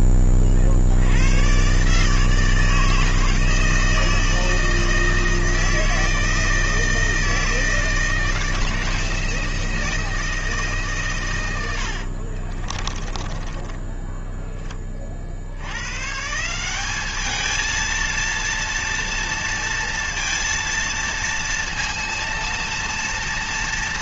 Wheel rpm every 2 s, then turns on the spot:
60, 160, 160, 160, 160, 140, 30, 30, 190, 230, 230, 230.
12-14